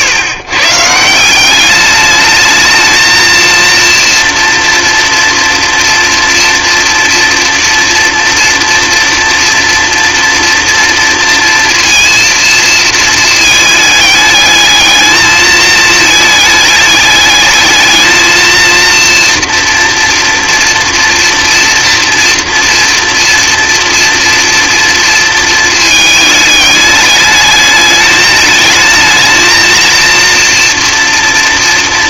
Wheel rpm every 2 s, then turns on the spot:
140, 220, 230, 230, 230, 230, 230, 210, 210, 230, 230, 230, 230, 210, 220, 230.
none